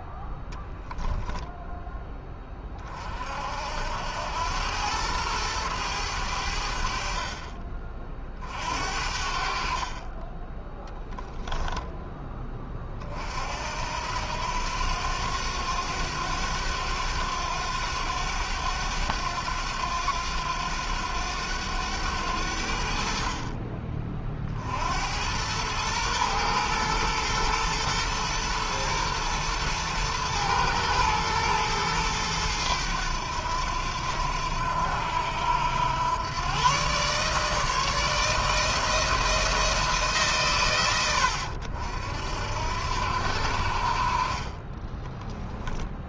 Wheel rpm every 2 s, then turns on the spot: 10, 30, 100, 70, 50, 10, 20, 90, 90, 100, 90, 70, 60, 110, 120, 110, 100, 90, 130, 160, 120, 70, 20.
none